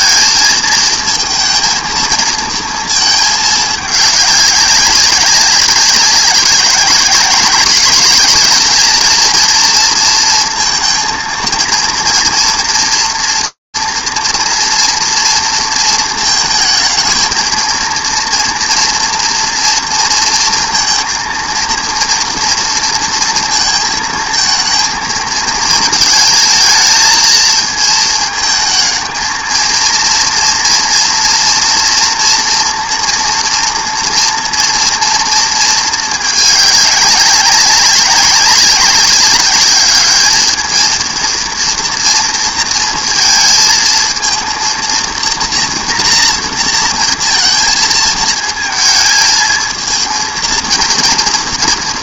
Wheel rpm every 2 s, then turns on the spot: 220, 220, 210, 200, 200, 230, 240, 230, 220, 240, 230, 230, 220, 220, 220, 230, 230, 240, 220, 200, 220, 230, 230, 230, 230, 230.
none